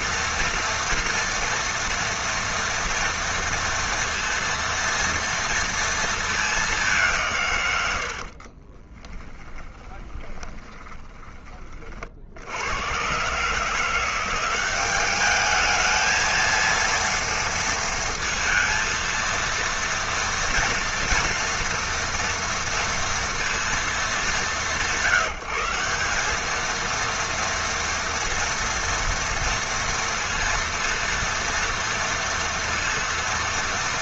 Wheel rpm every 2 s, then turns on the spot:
230, 230, 230, 180, 20, 20, 110, 200, 230, 230, 230, 230, 160, 230, 230, 230, 230.
8-12